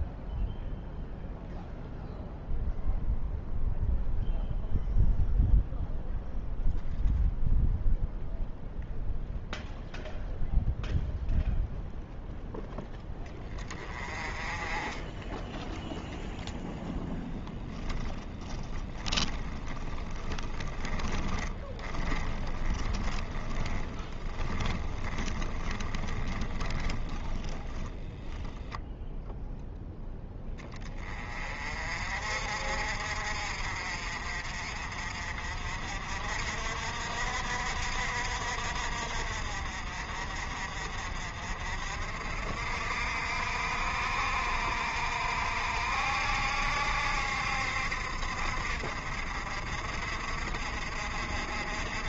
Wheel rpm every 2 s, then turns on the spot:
0, 0, 0, 0, 0, 0, 10, 20, 0, 20, 10, 20, 10, 10, 0, 10, 50, 40, 60, 60, 50, 60, 60, 70, 60, 50.
18-28